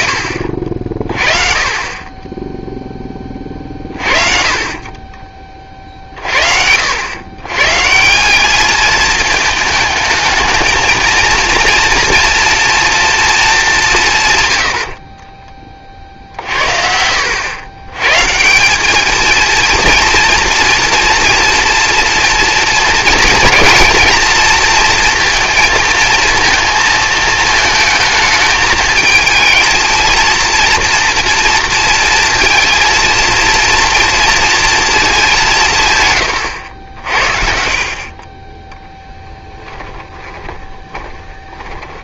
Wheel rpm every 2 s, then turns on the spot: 50, 0, 30, 80, 210, 220, 230, 90, 60, 180, 240, 230, 230, 220, 220, 230, 230, 230, 90, 10, 20.
4-6 14-16 40-42